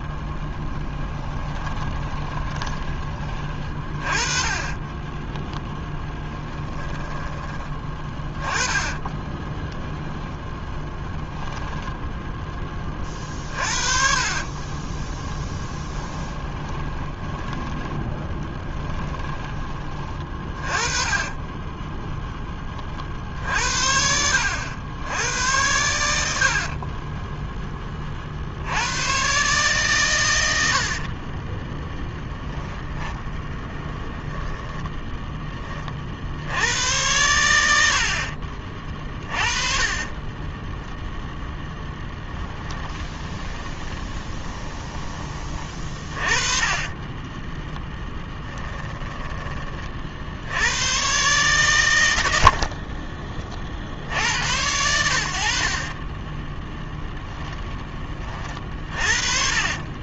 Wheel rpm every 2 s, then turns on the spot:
20, 20, 20, 10, 20, 0, 20, 20, 10, 10, 30, 30, 90, 30, 80, 70, 10, 10, 90, 30, 10, 20, 20, 20, 10, 100, 50, 90, 10, 40.
0-2 4-6 8-10 14-22 26-28 30-32 38-50 52-54